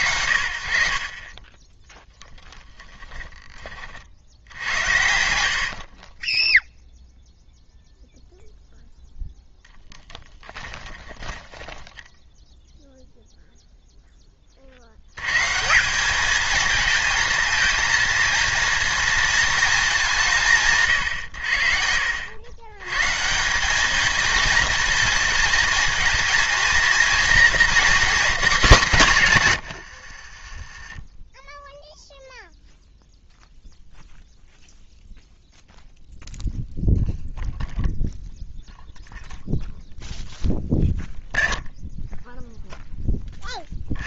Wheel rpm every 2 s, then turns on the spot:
60, 10, 80, 0, 0, 20, 0, 80, 220, 230, 110, 120, 230, 230, 240, 20, 0, 0, 0, 0, 0, 0.
2-6 10-12